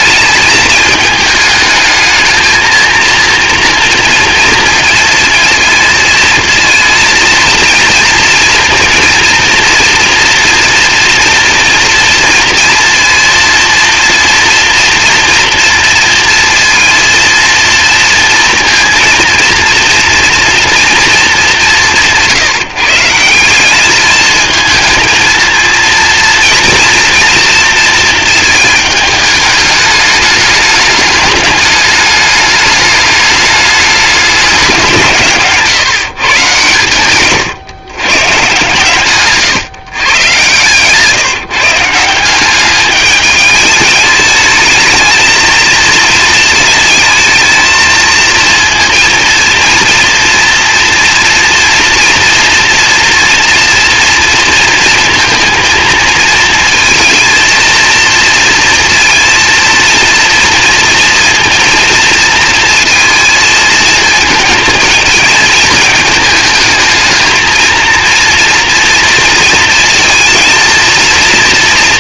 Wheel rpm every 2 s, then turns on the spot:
220, 230, 230, 230, 230, 240, 240, 230, 230, 230, 230, 160, 230, 230, 220, 210, 210, 180, 110, 130, 130, 200, 220, 220, 230, 240, 230, 230, 220, 230, 230, 230, 220, 220, 230, 230.
none